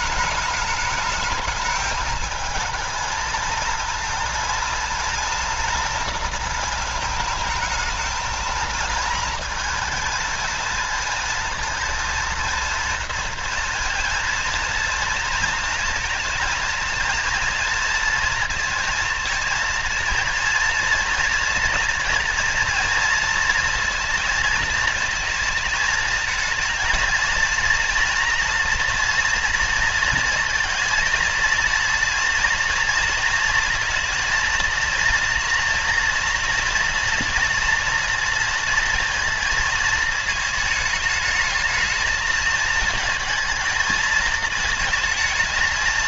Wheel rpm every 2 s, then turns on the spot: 210, 220, 230, 220, 220, 230, 230, 230, 230, 230, 230, 230, 220, 230, 230, 230, 230, 230, 230, 230, 220, 220, 220.
none